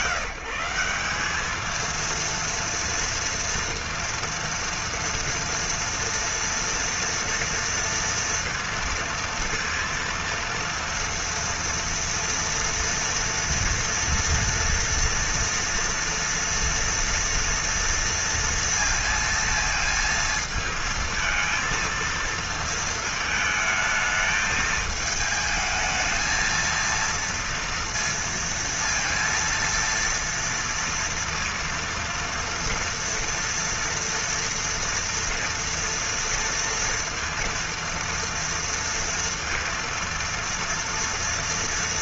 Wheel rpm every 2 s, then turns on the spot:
180, 230, 230, 230, 230, 230, 230, 240, 230, 230, 220, 230, 220, 230, 230, 230, 230, 230, 230, 230, 230.
none